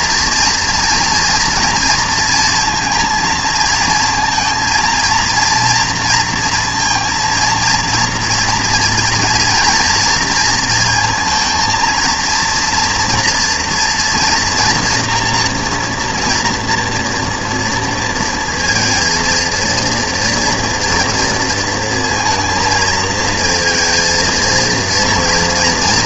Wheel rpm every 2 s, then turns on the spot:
230, 230, 220, 230, 230, 230, 230, 240, 240, 230, 230, 230, 230.
none